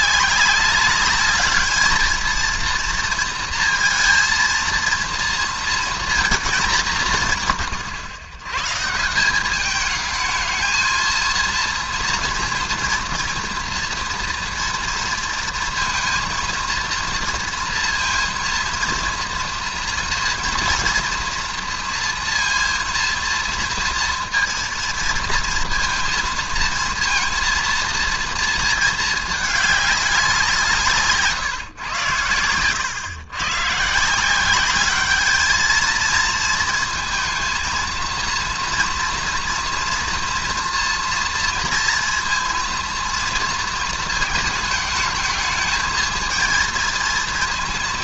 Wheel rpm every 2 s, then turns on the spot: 200, 230, 230, 210, 120, 220, 230, 230, 230, 230, 230, 230, 230, 230, 230, 170, 110, 190, 220, 230, 230, 230, 220, 220.
none